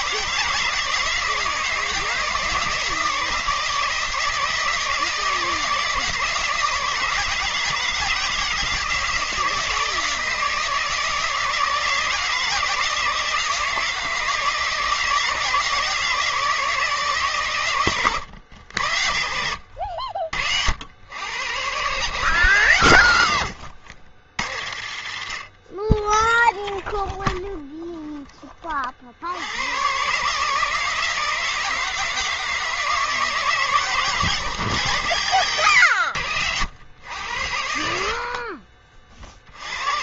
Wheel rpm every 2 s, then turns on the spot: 160, 160, 160, 160, 160, 160, 160, 160, 160, 90, 80, 130, 60, 10, 30, 160, 160, 130, 90, 40.
26-28 38-40